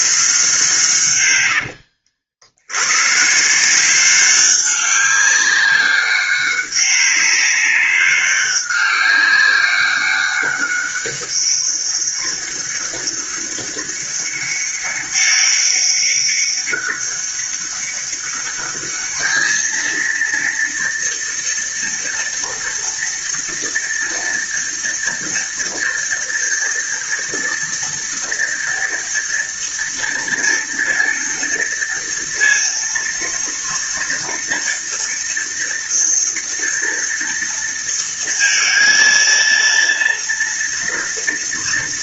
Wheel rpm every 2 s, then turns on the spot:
100, 150, 200, 200, 200, 200, 200, 200, 200, 220, 230, 230, 230, 230, 230, 230, 230, 230, 230, 230, 230.
0-2